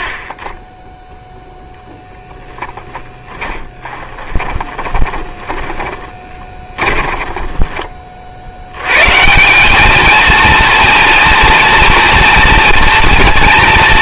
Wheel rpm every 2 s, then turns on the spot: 30, 10, 20, 20, 90, 230, 230.
2-8